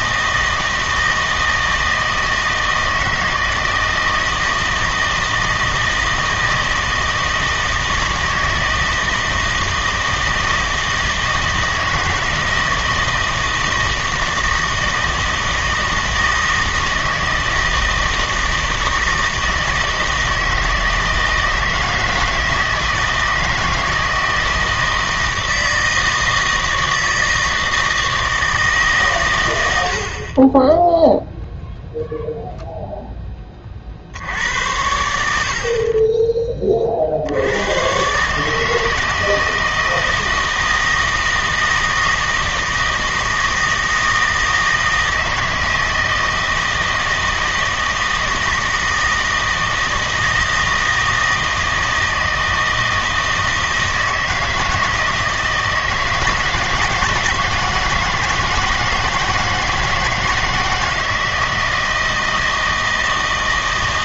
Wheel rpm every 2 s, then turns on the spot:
160, 160, 160, 160, 160, 160, 160, 160, 160, 160, 160, 160, 160, 160, 150, 10, 0, 90, 30, 160, 160, 160, 160, 160, 160, 160, 160, 160, 160, 160, 160, 160.
none